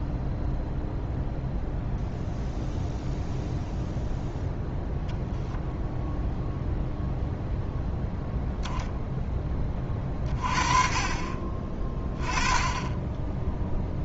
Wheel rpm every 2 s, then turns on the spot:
0, 0, 0, 0, 0, 30, 10.
none